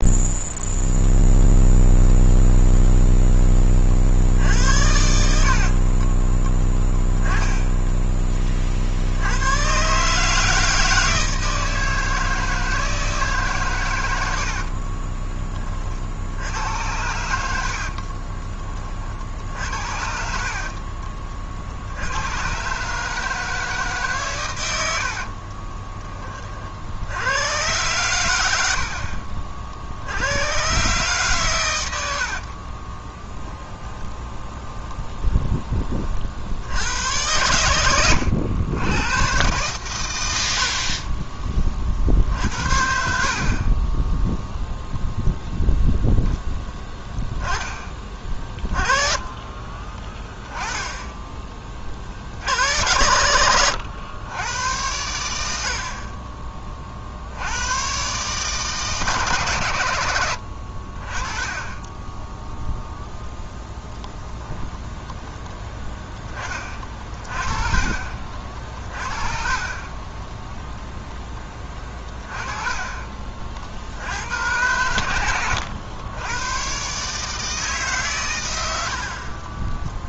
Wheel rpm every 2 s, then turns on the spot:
0, 0, 60, 10, 30, 160, 160, 60, 80, 20, 40, 120, 110, 40, 80, 100, 60, 30, 60, 100, 60, 60, 0, 0, 30, 10, 70, 100, 30, 150, 80, 10, 0, 20, 40, 10, 30, 90, 110, 100.
14-16 20-22 32-36 48-50 72-74